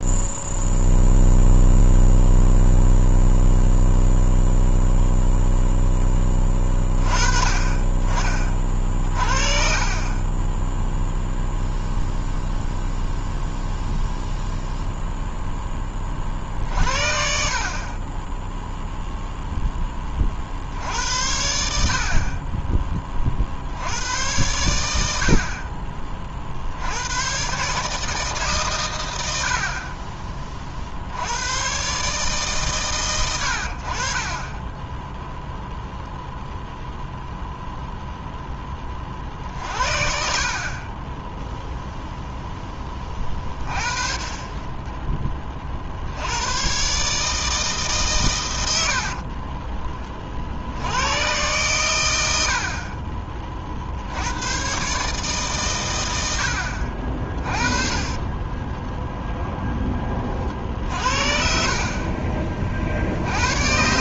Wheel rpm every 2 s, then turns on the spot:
0, 0, 0, 20, 40, 0, 0, 0, 50, 0, 70, 20, 90, 80, 120, 60, 120, 10, 0, 20, 20, 10, 20, 130, 70, 90, 40, 130, 60, 10, 50, 50.
48-50 52-54 58-60